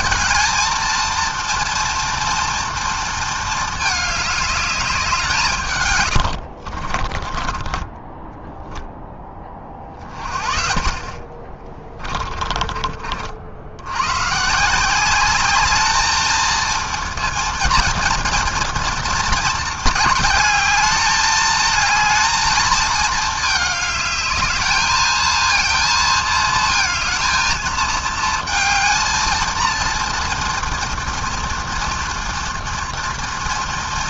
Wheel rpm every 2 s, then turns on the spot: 230, 230, 170, 30, 20, 30, 60, 200, 230, 220, 220, 220, 220, 220, 230, 230, 230.
6-8